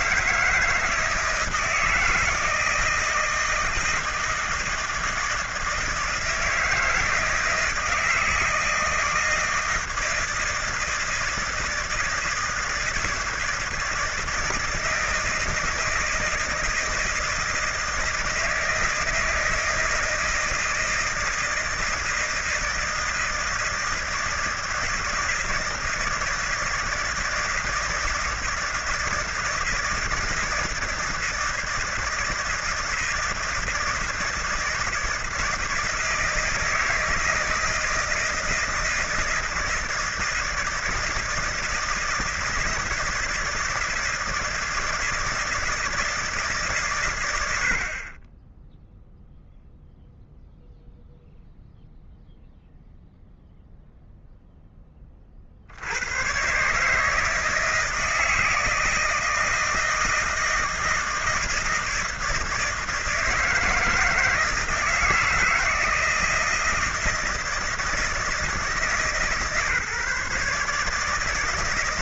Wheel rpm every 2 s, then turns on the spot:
160, 160, 160, 160, 160, 160, 160, 160, 160, 160, 160, 160, 160, 160, 160, 160, 160, 160, 160, 160, 160, 160, 160, 140, 10, 0, 0, 10, 130, 160, 160, 160, 160, 160, 160, 150.
none